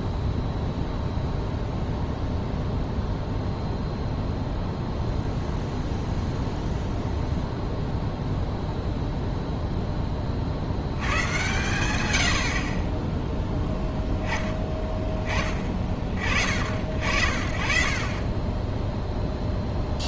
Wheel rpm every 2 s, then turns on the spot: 0, 0, 0, 0, 0, 70, 60, 10, 50, 10.
none